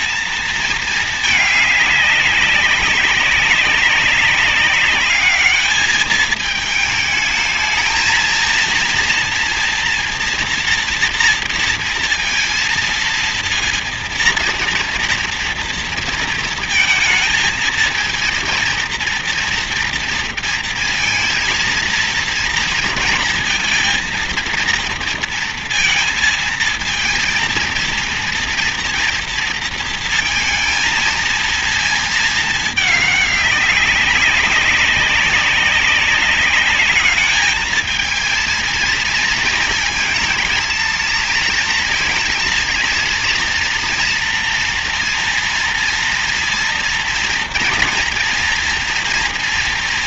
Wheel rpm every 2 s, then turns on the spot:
220, 200, 200, 220, 230, 230, 230, 230, 230, 230, 230, 230, 230, 230, 230, 230, 220, 200, 200, 220, 230, 230, 230, 230, 230.
none